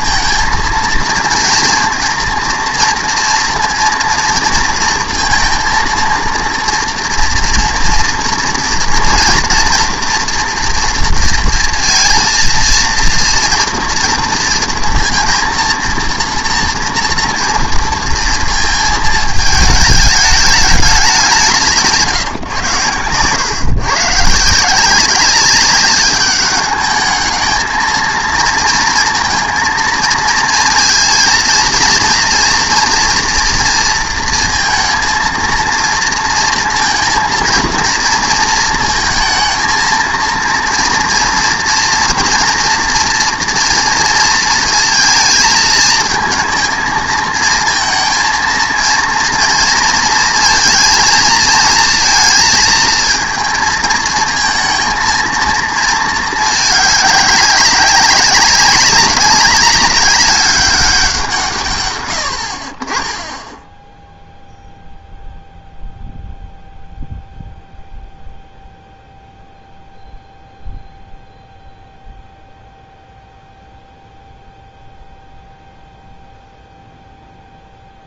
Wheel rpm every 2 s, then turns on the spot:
230, 230, 230, 230, 230, 230, 230, 230, 240, 220, 220, 120, 170, 200, 230, 230, 230, 230, 230, 220, 230, 230, 230, 230, 230, 230, 230, 220, 210, 200, 200, 50, 0, 0, 0, 0, 0, 0, 0.
none